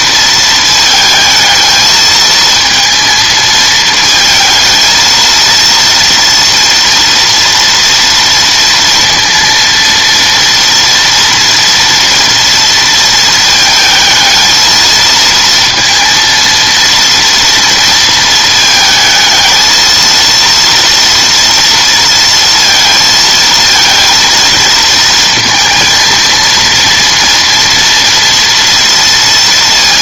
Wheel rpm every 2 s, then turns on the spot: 220, 230, 220, 230, 230, 230, 230, 220, 230, 220, 230, 230, 230, 230, 230.
none